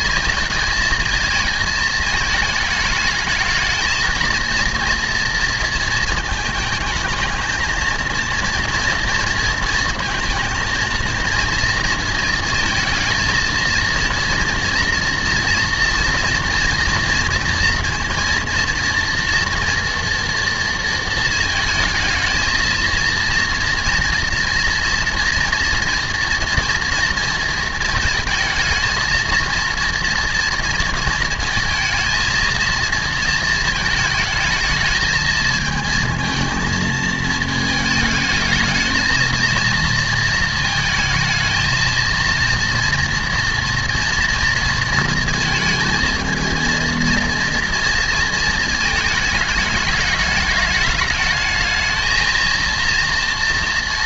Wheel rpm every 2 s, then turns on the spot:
230, 220, 230, 220, 230, 220, 230, 230, 230, 230, 230, 220, 230, 230, 220, 230, 230, 220, 230, 220, 220, 230, 230, 230, 230, 210, 220.
none